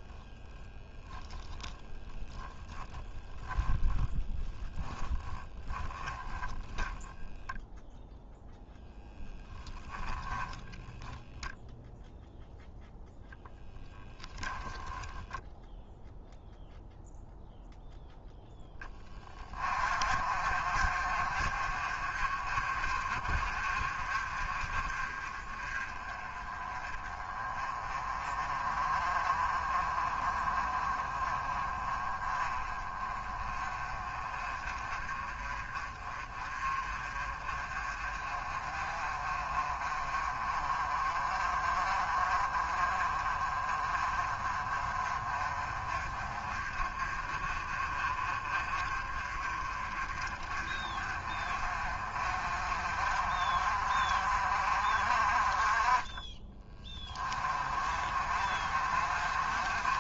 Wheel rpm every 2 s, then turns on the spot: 10, 10, 0, 10, 0, 0, 0, 10, 0, 10, 40, 40, 30, 20, 30, 30, 30, 30, 30, 40, 30, 30, 30, 30, 30, 40, 40, 40, 20, 40.
0-4 6-8